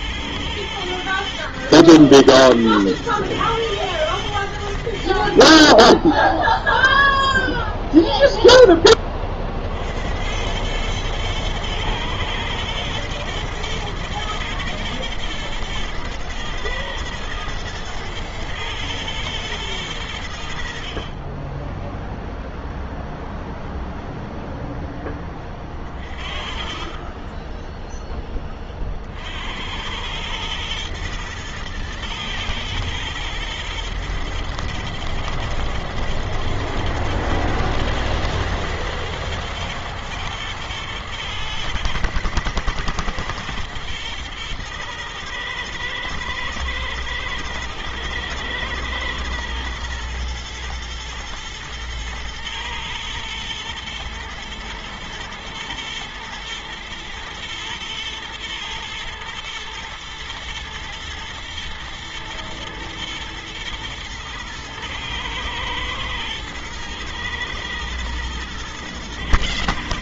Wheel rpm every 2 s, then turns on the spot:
110, 110, 30, 0, 50, 110, 110, 110, 110, 110, 20, 0, 20, 20, 60, 120, 120, 110, 110, 120, 110, 120, 120, 110, 110, 110, 110, 110, 110, 110, 120, 110, 110, 120, 120.
24-28